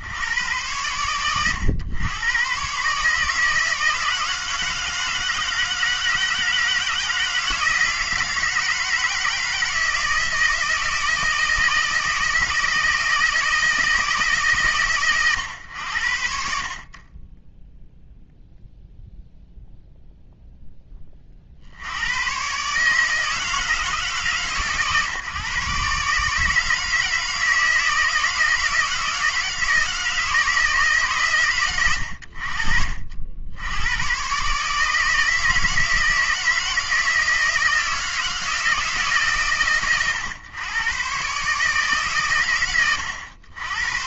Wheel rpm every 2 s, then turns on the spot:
100, 120, 160, 160, 160, 160, 160, 130, 50, 0, 10, 130, 140, 150, 160, 160, 70, 140, 160, 160, 100, 90.
none